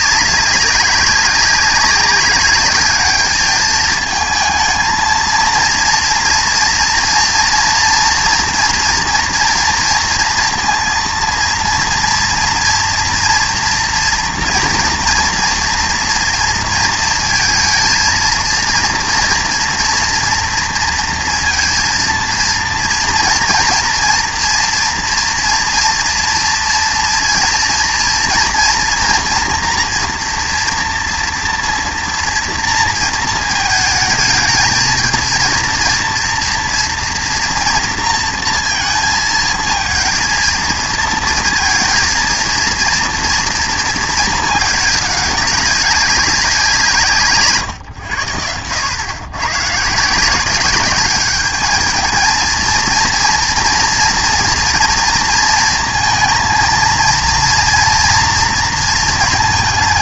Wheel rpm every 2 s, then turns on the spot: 190, 210, 220, 230, 230, 230, 240, 230, 230, 230, 230, 230, 230, 230, 230, 230, 230, 220, 230, 230, 230, 230, 210, 180, 90, 200, 230, 230, 230, 230.
none